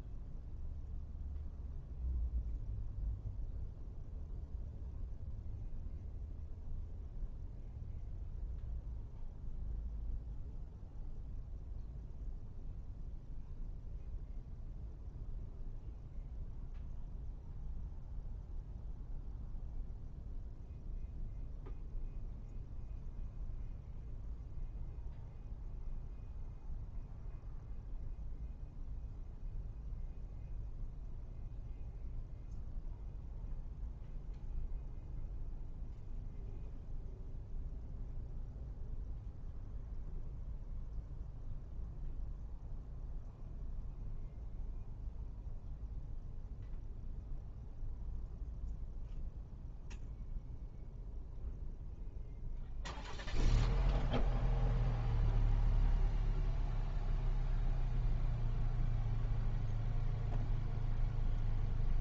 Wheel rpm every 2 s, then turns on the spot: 0, 0, 0, 0, 0, 0, 0, 0, 0, 0, 0, 0, 0, 0, 0, 0, 0, 0, 0, 0, 0, 0, 0, 0, 0, 0, 0, 0, 0, 0, 0.
none